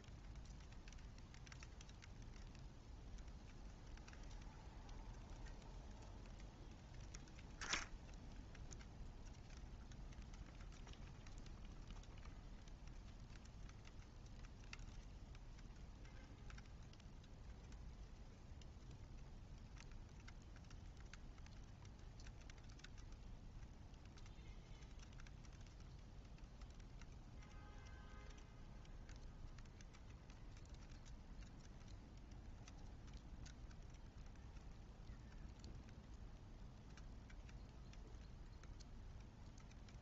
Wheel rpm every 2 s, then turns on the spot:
0, 0, 0, 0, 0, 0, 0, 0, 0, 0, 0, 0, 0, 0, 0, 0, 0, 0, 0, 0.
none